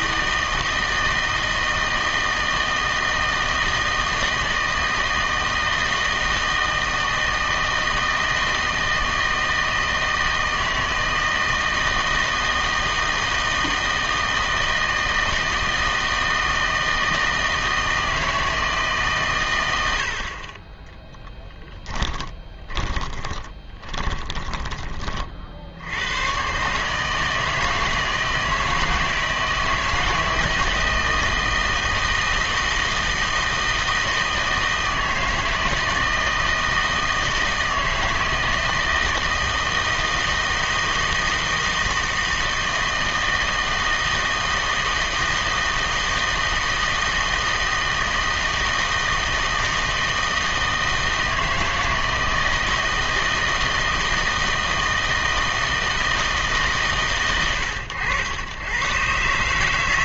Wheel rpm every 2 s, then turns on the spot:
160, 160, 160, 160, 160, 160, 160, 160, 160, 160, 30, 20, 20, 140, 160, 160, 160, 160, 160, 160, 160, 160, 160, 160, 160, 160, 160, 160, 140, 110.
22-24